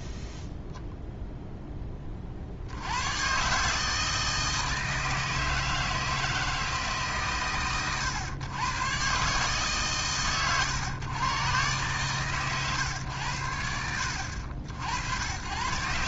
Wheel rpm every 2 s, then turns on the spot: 0, 100, 160, 140, 100, 100, 120, 100.
none